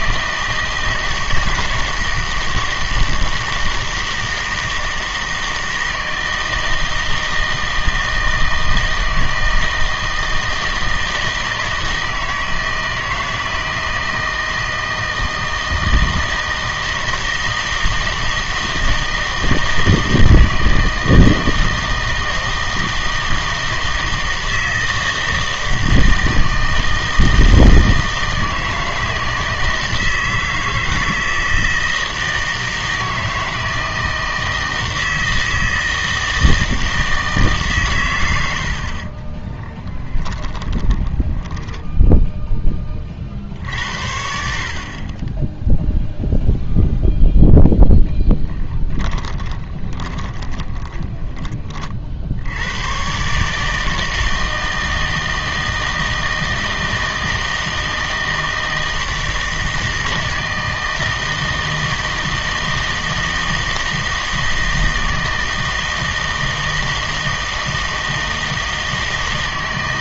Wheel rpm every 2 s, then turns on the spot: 160, 160, 160, 160, 160, 160, 160, 160, 160, 160, 160, 160, 160, 160, 160, 160, 160, 160, 160, 70, 20, 10, 60, 0, 10, 20, 90, 160, 160, 160, 160, 160, 160, 160, 160.
40-42 48-52